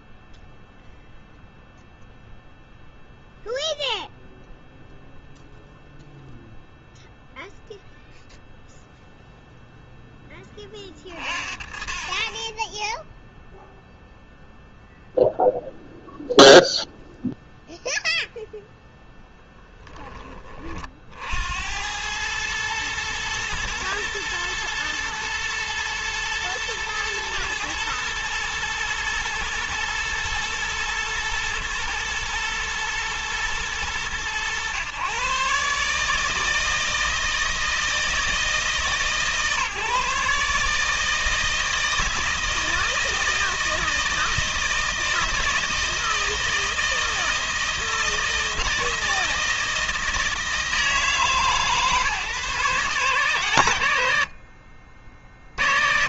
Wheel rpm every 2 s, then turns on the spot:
0, 0, 0, 0, 0, 30, 10, 0, 0, 0, 50, 110, 110, 110, 110, 120, 110, 110, 160, 160, 150, 160, 160, 160, 160, 160, 140, 50.
none